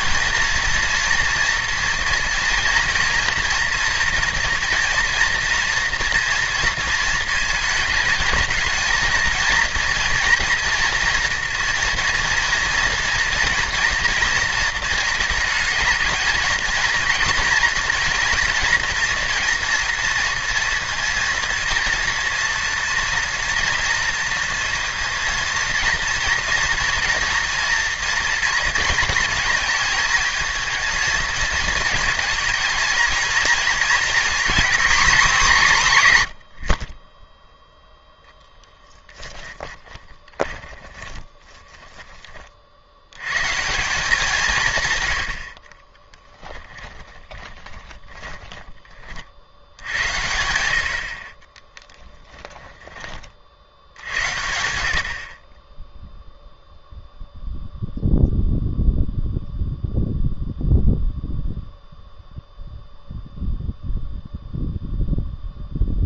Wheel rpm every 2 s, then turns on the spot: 230, 230, 230, 230, 220, 230, 230, 230, 230, 230, 230, 230, 230, 230, 220, 230, 230, 260, 60, 10, 10, 50, 140, 20, 30, 80, 10, 70, 0, 0, 0, 0, 0.
38-42 46-48 52-54